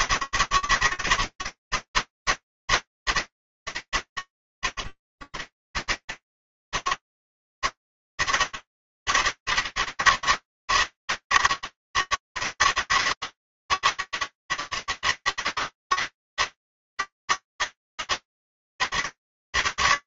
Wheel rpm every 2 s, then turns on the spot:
160, 160, 100, 150, 160, 160, 160, 160, 160, 150.
none